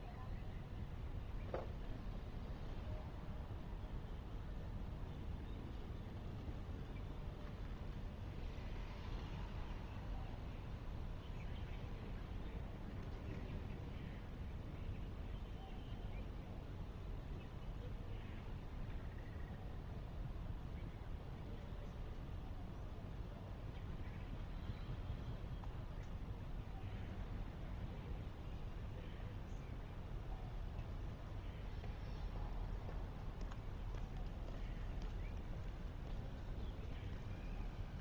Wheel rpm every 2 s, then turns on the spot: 0, 0, 0, 0, 0, 0, 0, 0, 0, 0, 0, 0, 0, 0, 0, 0, 0, 0, 0.
none